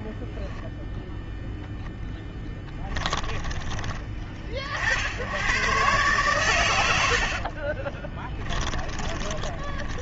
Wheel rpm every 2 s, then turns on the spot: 0, 20, 100, 40, 20.
2-4 6-10